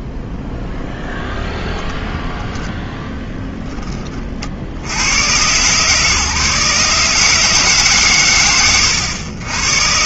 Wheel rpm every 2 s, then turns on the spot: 0, 0, 40, 150, 100.
none